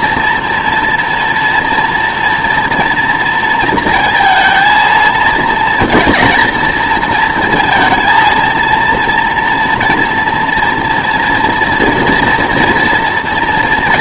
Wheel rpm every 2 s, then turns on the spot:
230, 240, 230, 230, 230, 230, 240.
none